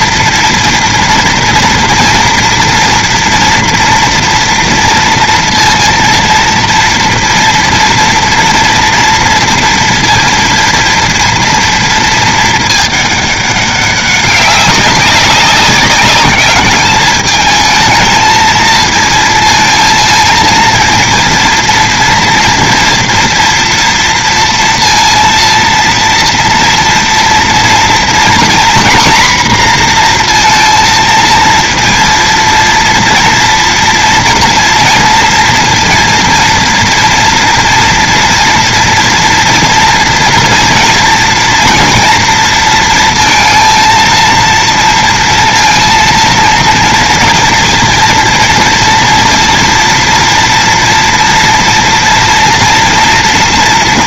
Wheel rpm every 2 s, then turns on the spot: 230, 240, 230, 230, 230, 230, 210, 200, 210, 230, 230, 230, 230, 230, 250, 230, 230, 230, 230, 230, 230, 230, 230, 230, 240, 240, 230.
none